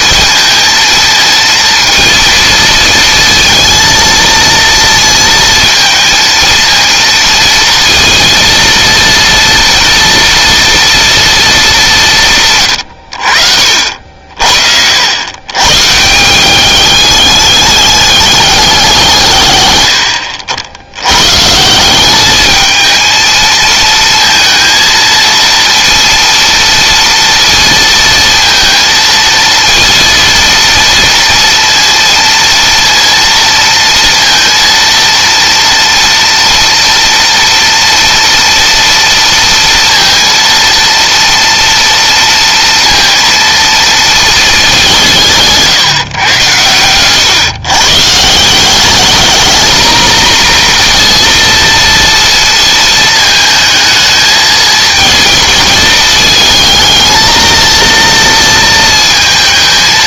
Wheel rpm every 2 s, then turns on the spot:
230, 230, 230, 230, 230, 230, 110, 90, 210, 170, 90, 220, 230, 230, 230, 230, 230, 230, 230, 230, 230, 230, 180, 100, 200, 240, 220, 220, 220, 230.
none